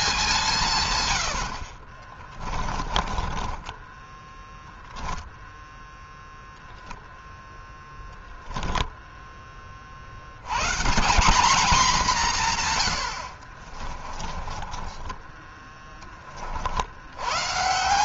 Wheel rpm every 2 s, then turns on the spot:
170, 30, 10, 0, 10, 110, 160, 20, 40.
2-6 14-16